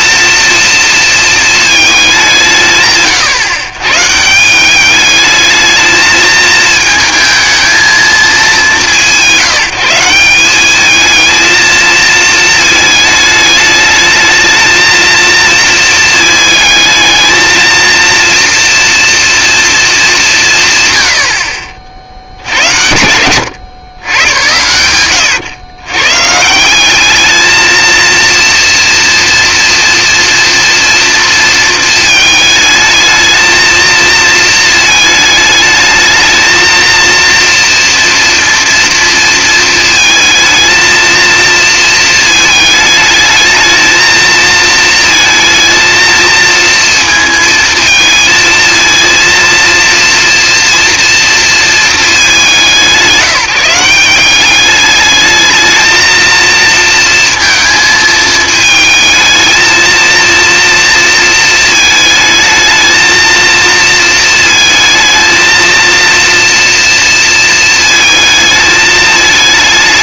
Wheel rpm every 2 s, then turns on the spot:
230, 150, 190, 220, 180, 210, 220, 220, 220, 230, 140, 90, 90, 190, 230, 240, 220, 220, 230, 230, 230, 220, 220, 230, 230, 230, 170, 210, 230, 220, 230, 220, 220, 230, 220.
none